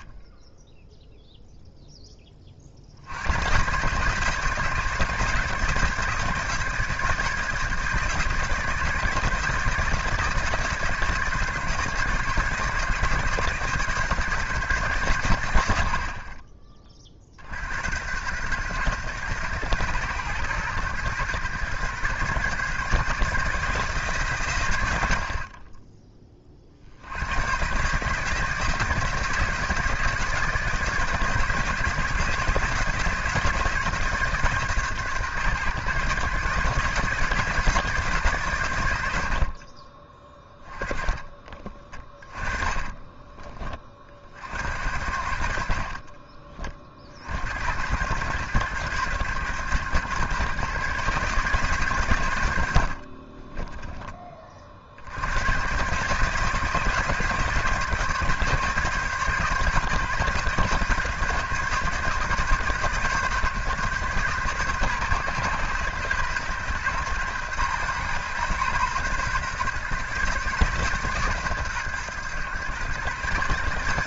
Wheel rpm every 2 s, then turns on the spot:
0, 60, 160, 160, 160, 160, 150, 140, 30, 120, 120, 140, 110, 50, 160, 160, 160, 140, 150, 110, 20, 20, 70, 40, 120, 130, 60, 50, 150, 150, 140, 130, 130, 120, 120, 140, 120.
40-44